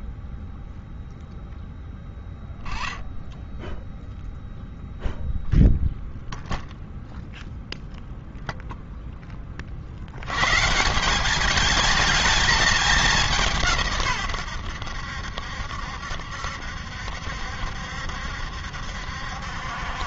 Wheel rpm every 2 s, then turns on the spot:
0, 0, 0, 0, 20, 190, 190, 80, 70, 70.
none